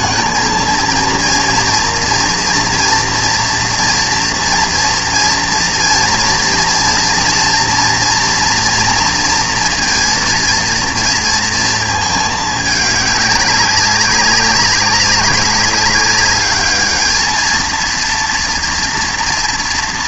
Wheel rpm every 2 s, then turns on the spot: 220, 230, 230, 240, 230, 230, 210, 200, 210, 230.
none